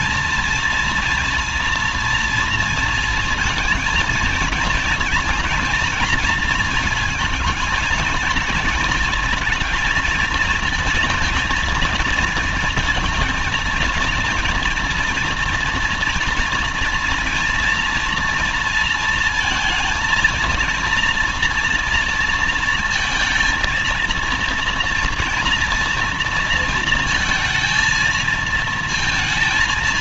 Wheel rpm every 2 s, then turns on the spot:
230, 230, 230, 220, 210, 220, 230, 230, 230, 230, 230, 230, 230, 230, 230.
none